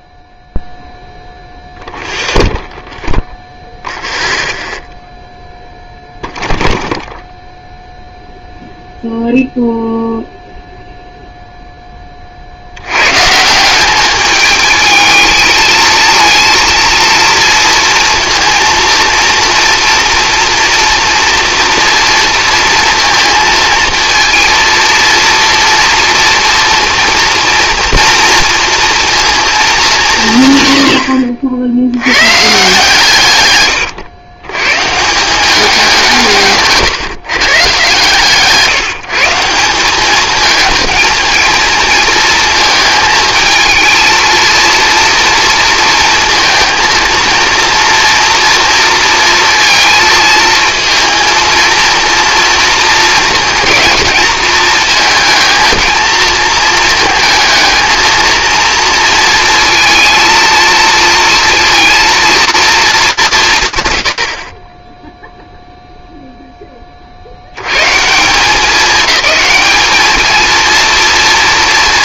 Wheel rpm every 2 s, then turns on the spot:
0, 0, 0, 0, 0, 0, 80, 210, 230, 230, 230, 230, 230, 230, 230, 110, 150, 140, 150, 170, 220, 220, 230, 230, 230, 220, 230, 220, 230, 230, 230, 220, 20, 20, 210, 230.
none